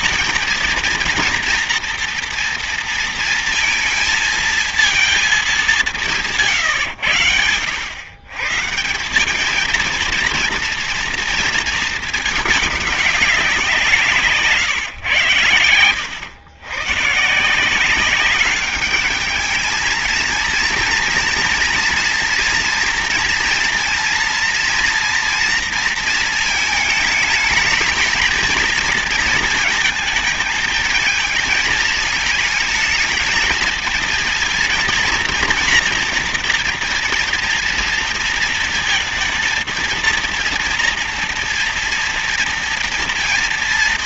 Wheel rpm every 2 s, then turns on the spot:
230, 230, 230, 130, 170, 230, 210, 120, 130, 210, 230, 230, 230, 220, 220, 220, 220, 230, 240, 230, 230, 230.
none